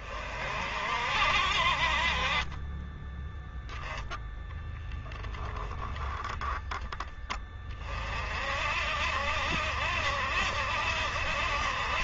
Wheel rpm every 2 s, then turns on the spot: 60, 10, 0, 10, 60, 70.
none